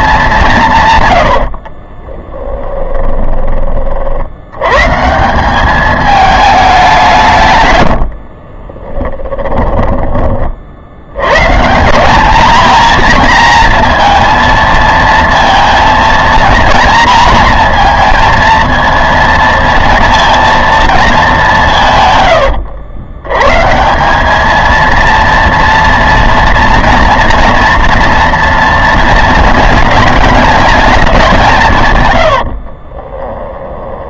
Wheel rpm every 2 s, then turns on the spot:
150, 10, 120, 200, 30, 60, 230, 230, 220, 230, 230, 110, 230, 240, 230, 210, 50.
2-4 8-10 22-24 32-34